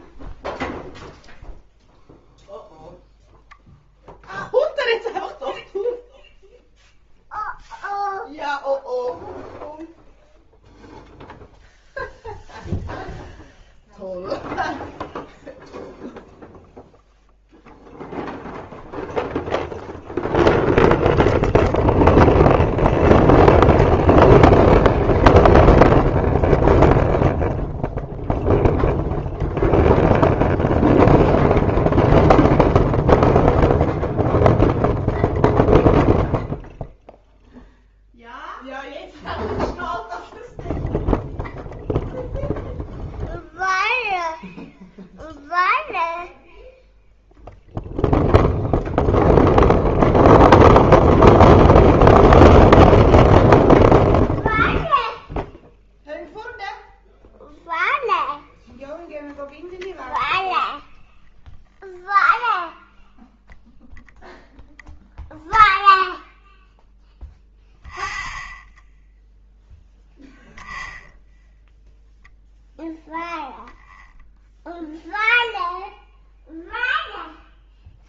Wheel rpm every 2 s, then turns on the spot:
0, 0, 0, 0, 0, 0, 0, 0, 0, 0, 0, 0, 0, 0, 0, 0, 0, 0, 0, 0, 0, 0, 0, 0, 0, 0, 0, 0, 0, 0, 0, 0, 0, 0, 0, 0, 0, 0, 0.
none